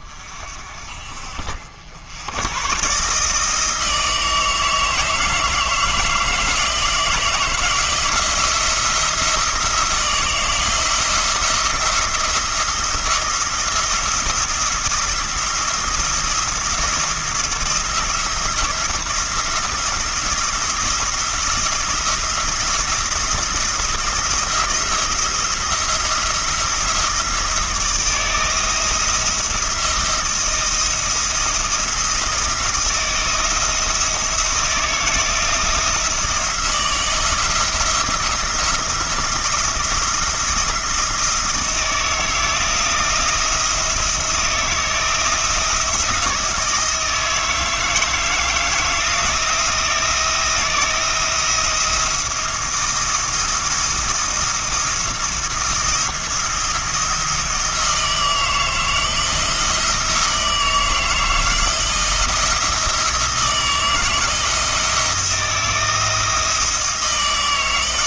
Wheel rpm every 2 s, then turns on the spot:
40, 130, 160, 160, 170, 160, 170, 170, 170, 170, 170, 170, 170, 170, 170, 170, 170, 170, 170, 170, 170, 160, 160, 160, 160, 170, 170, 160, 170, 160, 160, 170, 170, 160.
none